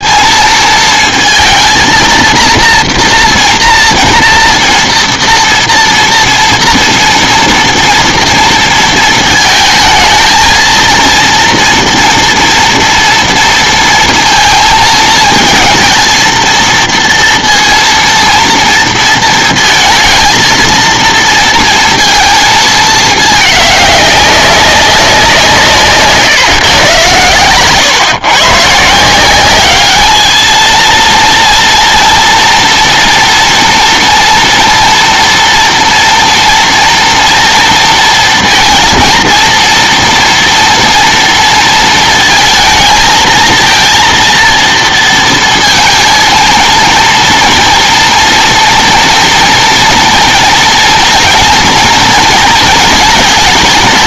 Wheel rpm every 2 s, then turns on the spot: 230, 240, 230, 230, 230, 230, 230, 230, 230, 230, 230, 220, 200, 120, 150, 220, 230, 230, 230, 230, 230, 220, 230, 230, 230, 230, 220.
none